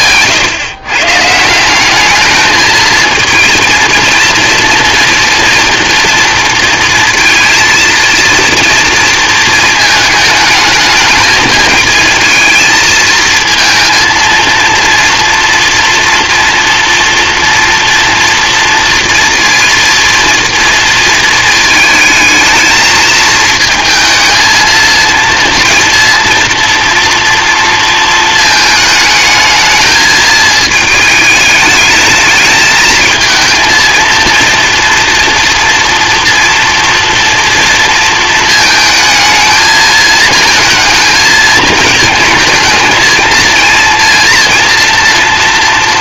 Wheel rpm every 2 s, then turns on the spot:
130, 220, 240, 230, 230, 210, 220, 230, 230, 230, 230, 220, 230, 230, 220, 220, 220, 230, 230, 220, 220, 220, 230.
none